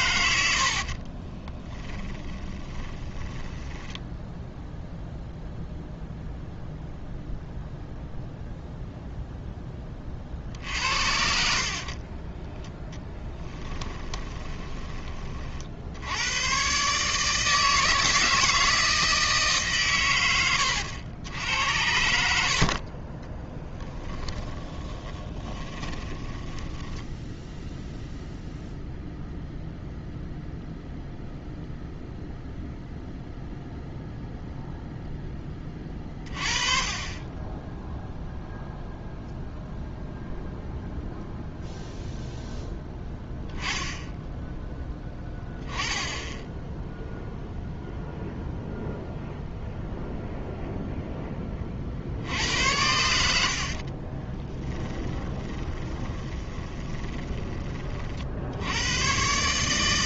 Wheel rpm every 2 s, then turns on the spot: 60, 10, 0, 0, 0, 60, 10, 20, 130, 160, 90, 40, 20, 10, 0, 0, 0, 0, 30, 0, 0, 0, 10, 0, 0, 0, 90, 10, 20, 90.
0-4 22-28 54-58